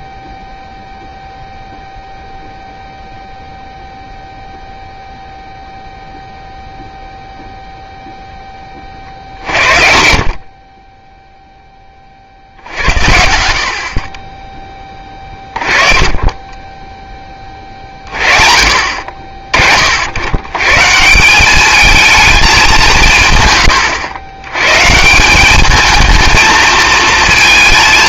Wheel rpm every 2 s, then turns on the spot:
0, 0, 0, 0, 60, 10, 60, 30, 20, 40, 200, 120, 200, 230.
14-16